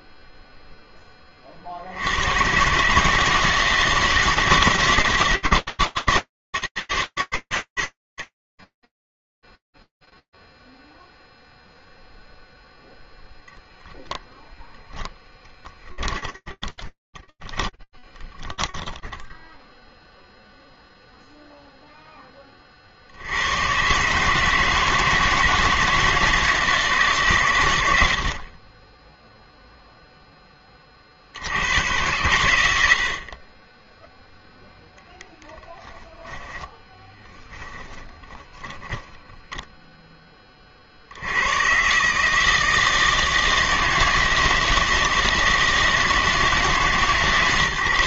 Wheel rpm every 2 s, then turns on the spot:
0, 100, 160, 150, 70, 0, 0, 10, 20, 20, 0, 10, 150, 160, 70, 20, 100, 0, 10, 10, 100, 160, 160, 140.
16-20 36-40